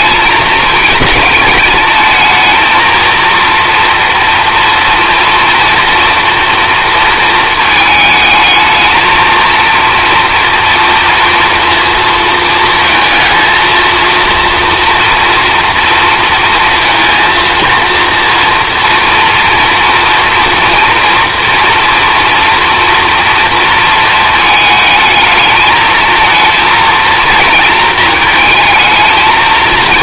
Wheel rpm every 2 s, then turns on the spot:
220, 230, 230, 230, 220, 230, 230, 230, 230, 230, 230, 240, 220, 230, 220.
none